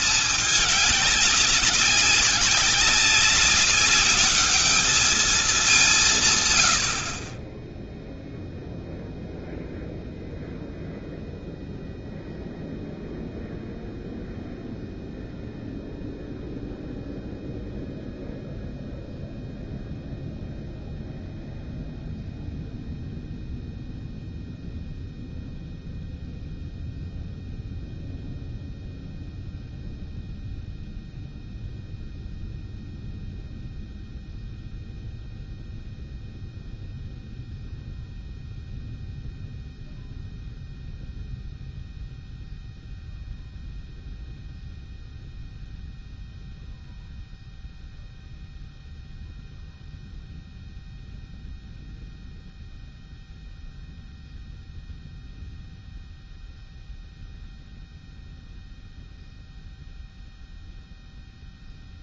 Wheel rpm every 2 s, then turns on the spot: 210, 200, 210, 110, 0, 0, 0, 0, 0, 0, 0, 0, 0, 0, 0, 0, 0, 0, 0, 0, 0, 0, 0, 0, 0, 0, 0, 0, 0, 0, 0.
none